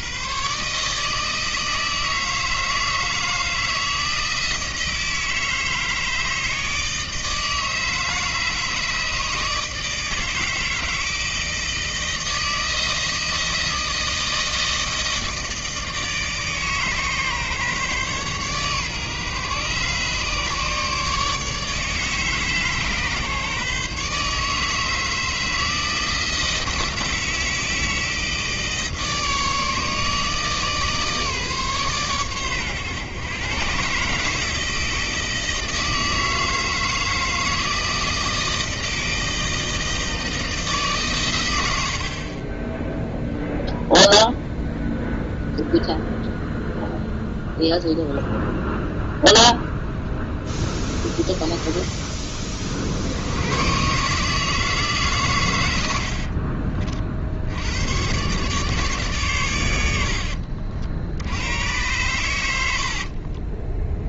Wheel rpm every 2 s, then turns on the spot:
150, 160, 160, 160, 150, 160, 160, 160, 150, 140, 150, 140, 160, 160, 160, 150, 120, 160, 160, 160, 140, 10, 0, 0, 0, 10, 60, 150, 40, 140, 60, 60.
none